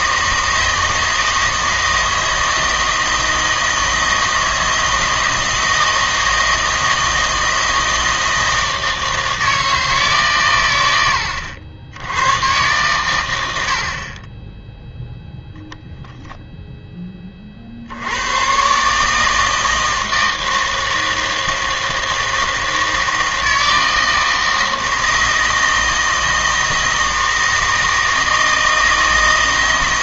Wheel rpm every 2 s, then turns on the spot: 160, 160, 160, 160, 160, 120, 120, 10, 0, 120, 160, 160, 160, 160, 160.
none